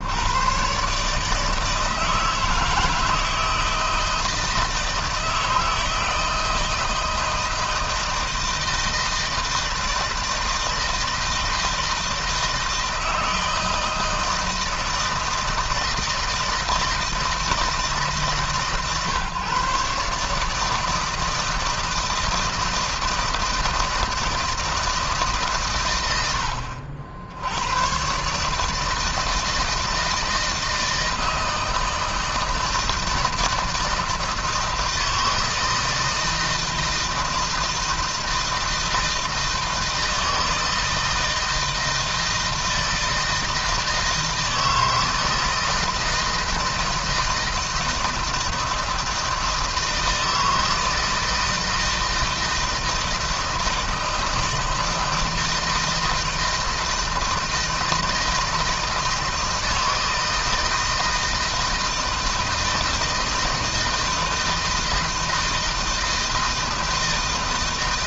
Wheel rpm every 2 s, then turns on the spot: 140, 160, 160, 160, 160, 160, 160, 160, 160, 140, 160, 160, 150, 70, 160, 160, 160, 160, 160, 160, 160, 160, 160, 160, 160, 160, 160, 160, 160, 160, 160, 160, 160, 160.
none